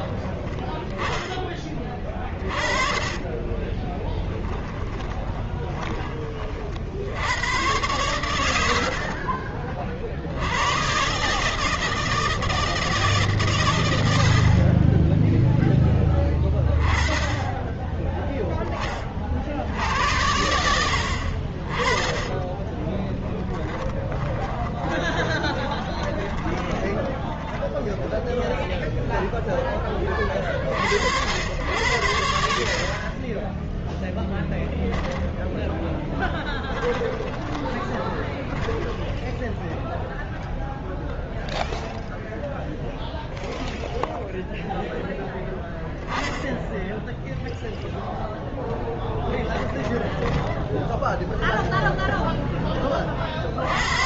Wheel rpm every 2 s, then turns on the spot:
10, 40, 20, 60, 70, 130, 150, 30, 20, 20, 70, 20, 20, 20, 0, 70, 40, 10, 20, 10, 0, 0, 0, 10, 10, 10, 10.
2-6 8-10 22-28 32-34 36-40